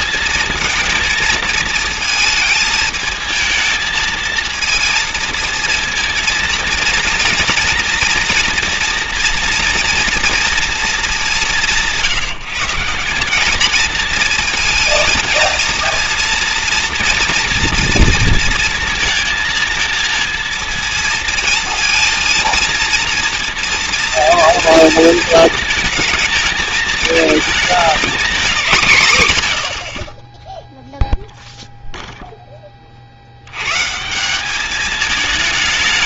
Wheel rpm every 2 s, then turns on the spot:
230, 220, 230, 230, 230, 230, 170, 220, 230, 230, 230, 220, 230, 220, 200, 0, 10, 190.
none